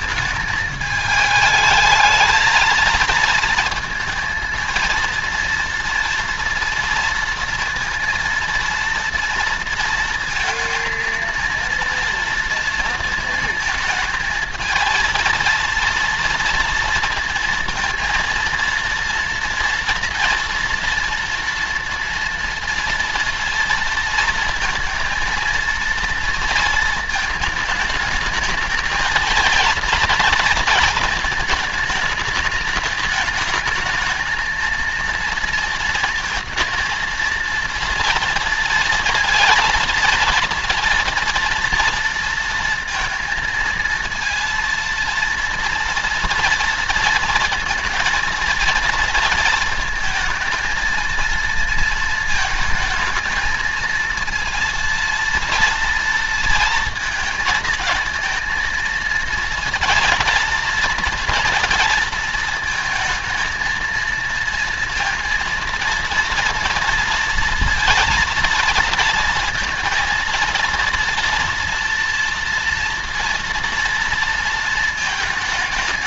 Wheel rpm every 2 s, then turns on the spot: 220, 230, 230, 240, 230, 220, 230, 220, 230, 230, 230, 230, 230, 230, 220, 230, 210, 230, 230, 230, 230, 230, 230, 230, 230, 230, 230, 230, 230, 220, 230, 220, 230, 230, 230, 230, 230, 230.
none